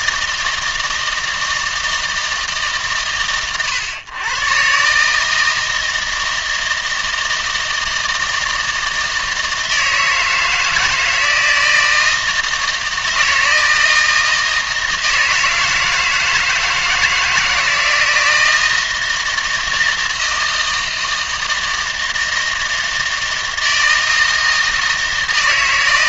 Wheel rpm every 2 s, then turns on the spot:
160, 130, 130, 160, 160, 160, 160, 160, 160, 160, 160, 160, 160.
none